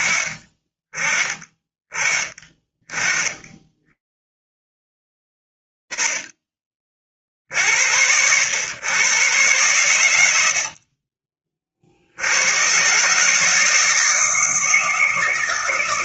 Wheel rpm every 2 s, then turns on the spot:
20, 30, 110, 40, 90, 100, 70, 160.
none